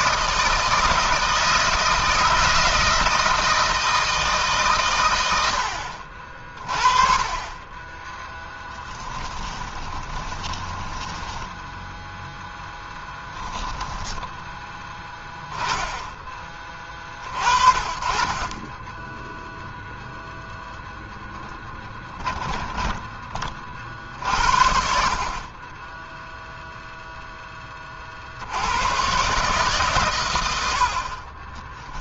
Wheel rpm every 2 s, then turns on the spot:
160, 160, 130, 30, 10, 20, 10, 10, 30, 20, 0, 10, 50, 0, 100, 80.
8-12 22-24